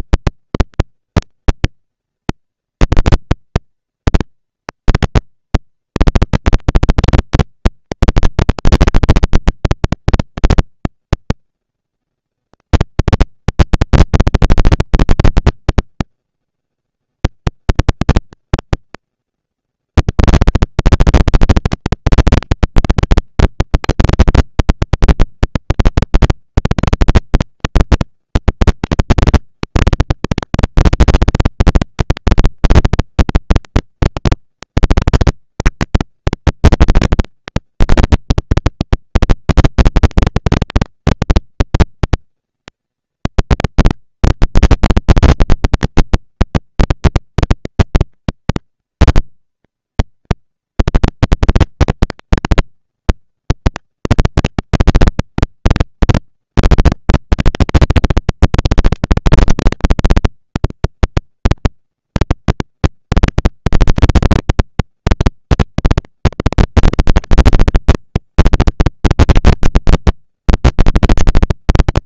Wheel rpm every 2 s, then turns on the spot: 230, 230, 230, 230, 230, 230, 230, 230, 230, 230, 230, 230, 210, 190, 200, 220, 230, 230, 220, 230, 230, 230, 230, 230, 230, 230, 220, 230, 230, 230, 230, 230, 230, 230, 220, 200.
none